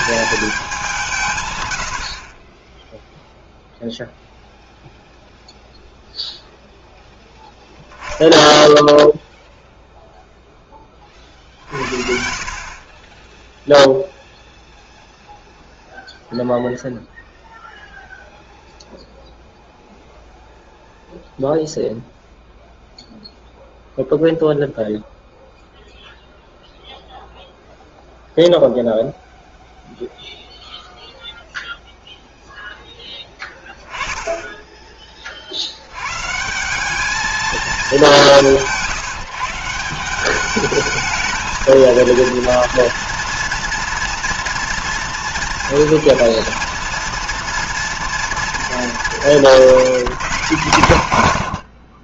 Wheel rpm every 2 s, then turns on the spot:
180, 10, 0, 0, 0, 20, 20, 0, 0, 0, 0, 0, 0, 0, 0, 0, 0, 20, 180, 170, 210, 230, 230, 230, 220, 170.
none